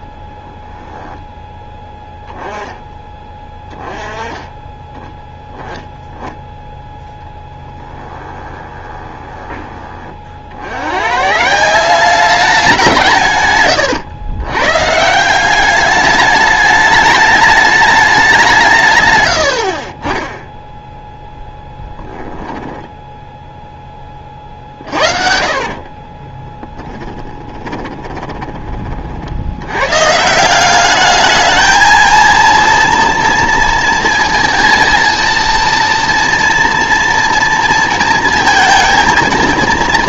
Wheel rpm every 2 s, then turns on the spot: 0, 10, 10, 10, 20, 100, 180, 140, 210, 150, 10, 10, 40, 10, 30, 190, 230, 230, 240, 230.
8-10 22-28